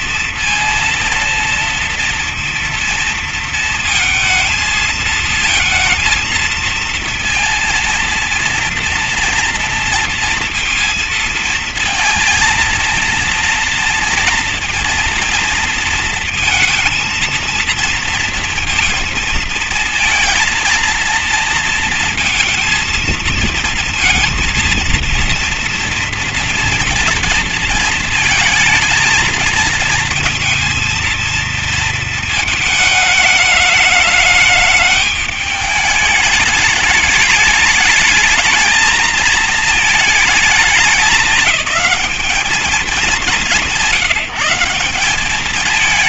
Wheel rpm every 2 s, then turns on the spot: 230, 230, 230, 230, 230, 230, 230, 230, 230, 230, 230, 220, 230, 230, 220, 230, 220, 210, 210, 220, 210, 210, 180.
none